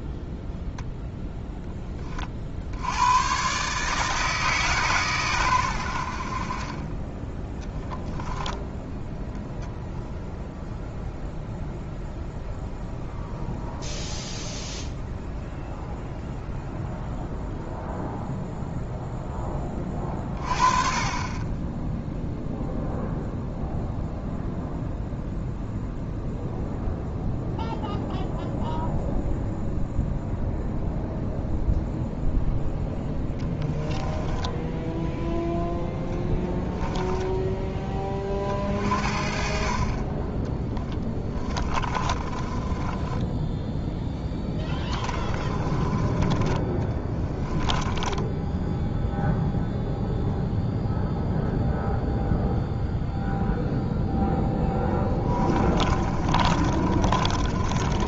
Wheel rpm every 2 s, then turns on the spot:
0, 70, 140, 30, 10, 0, 0, 0, 0, 0, 30, 0, 0, 0, 0, 0, 0, 10, 10, 40, 10, 20, 20, 30, 10, 0, 0, 10, 30.
8-10 34-38 40-46 48-50 54-58